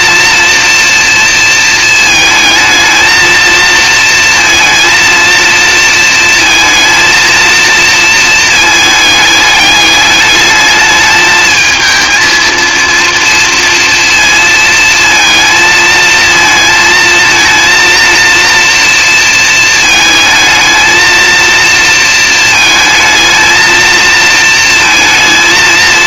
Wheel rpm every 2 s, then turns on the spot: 230, 220, 230, 230, 220, 210, 230, 220, 230, 230, 220, 220, 230.
none